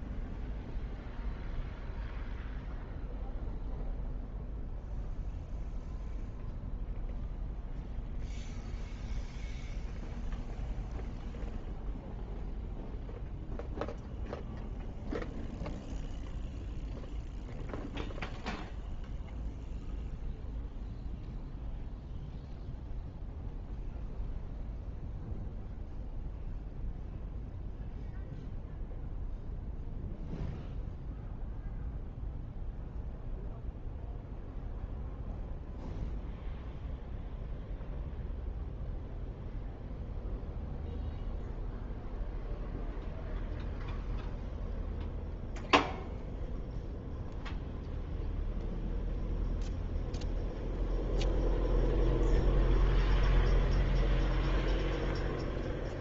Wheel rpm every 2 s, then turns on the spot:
0, 0, 0, 0, 0, 0, 0, 0, 0, 0, 0, 0, 0, 0, 0, 0, 0, 0, 0, 0, 0, 0, 0, 0, 0, 0, 0, 0.
none